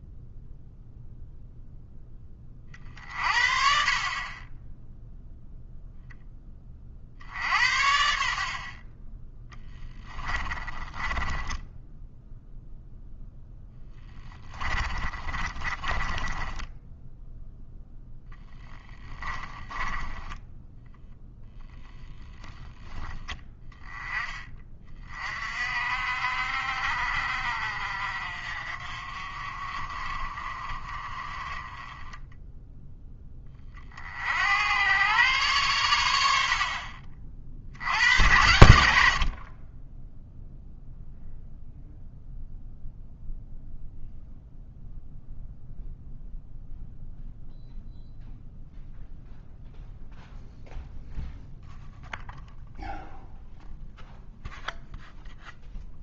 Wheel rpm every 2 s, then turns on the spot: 0, 40, 0, 40, 30, 20, 0, 30, 10, 10, 0, 10, 30, 50, 50, 30, 10, 100, 50, 80, 0, 0, 0, 0, 0, 0, 0, 0.
10-12 14-20 36-38